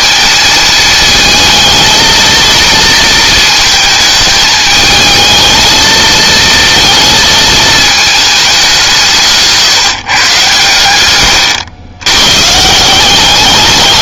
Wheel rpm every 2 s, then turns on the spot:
230, 230, 220, 230, 190, 120, 160.
none